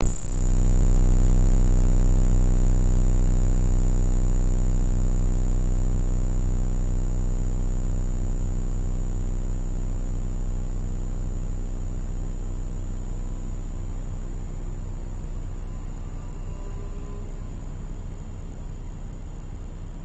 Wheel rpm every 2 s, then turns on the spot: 0, 0, 0, 0, 0, 0, 0, 0, 0, 0.
none